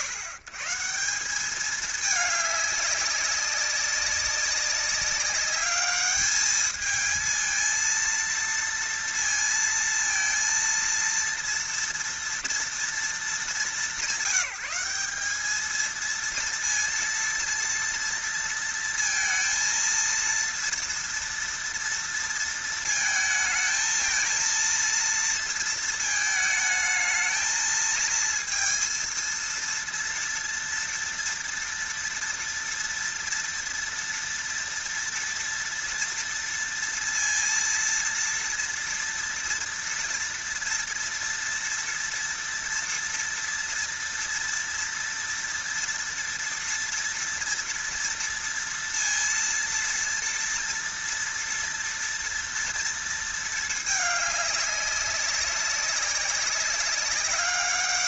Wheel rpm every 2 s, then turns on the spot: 120, 200, 200, 220, 230, 230, 230, 200, 230, 230, 230, 230, 230, 220, 230, 230, 230, 230, 230, 230, 230, 230, 230, 230, 230, 230, 230, 200, 190.
none